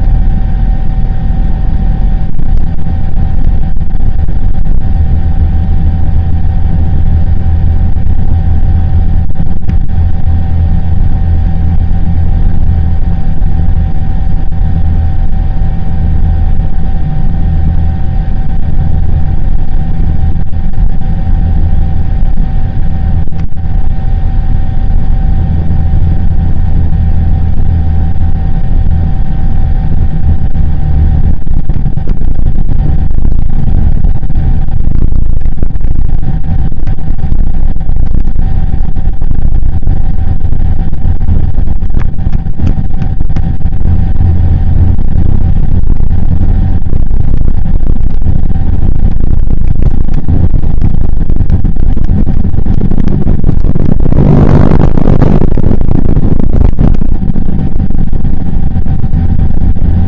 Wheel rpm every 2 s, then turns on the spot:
0, 0, 0, 0, 0, 0, 0, 0, 0, 0, 0, 0, 0, 0, 0, 0, 0, 0, 0, 0, 0, 0, 0, 0, 0, 0, 0, 0, 0, 0.
none